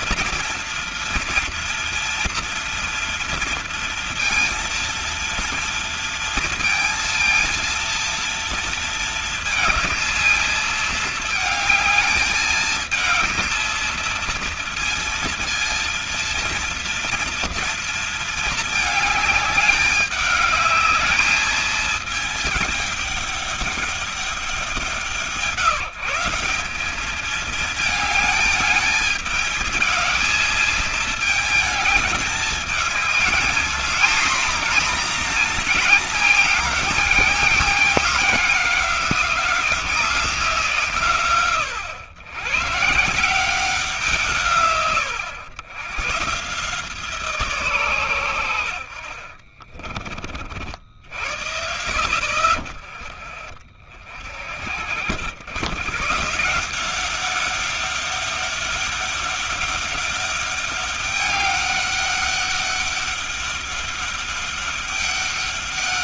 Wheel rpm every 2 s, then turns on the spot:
230, 230, 230, 230, 230, 220, 220, 230, 230, 220, 210, 210, 190, 190, 220, 220, 220, 240, 230, 200, 170, 130, 130, 150, 70, 50, 30, 70, 180, 200, 200, 200, 200.
none